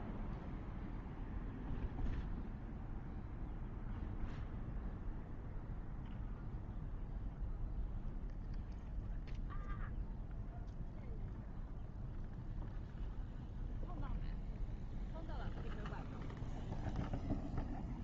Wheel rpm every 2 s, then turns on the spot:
0, 0, 0, 0, 0, 0, 0, 0, 0.
none